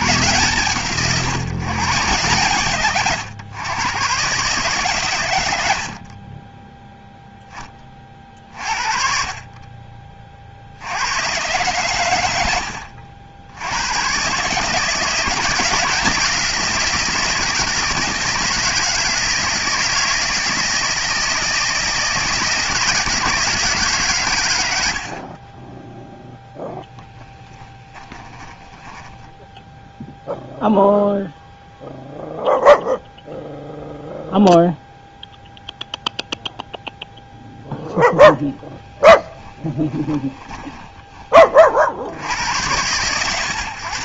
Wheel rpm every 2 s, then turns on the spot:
140, 130, 140, 10, 50, 60, 80, 150, 170, 170, 160, 170, 90, 0, 10, 0, 0, 0, 0, 10, 20, 100.
38-42